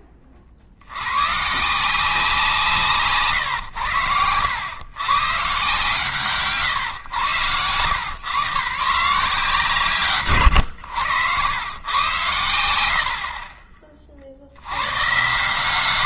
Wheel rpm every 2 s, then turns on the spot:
30, 170, 100, 140, 130, 110, 90, 30.
6-8